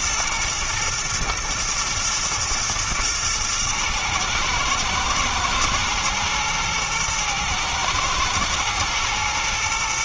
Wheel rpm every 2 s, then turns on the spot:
120, 120, 110, 110, 110.
none